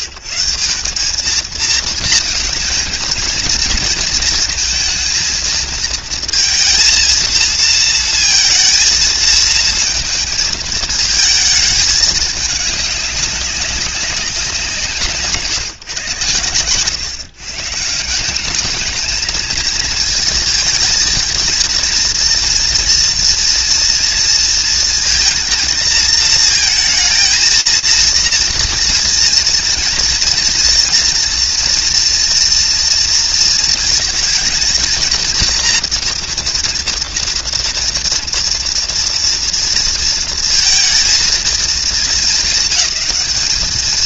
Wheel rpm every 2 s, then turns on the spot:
140, 220, 230, 220, 230, 230, 210, 190, 110, 200, 230, 240, 230, 220, 230, 230, 230, 230, 240, 230, 230, 210.
none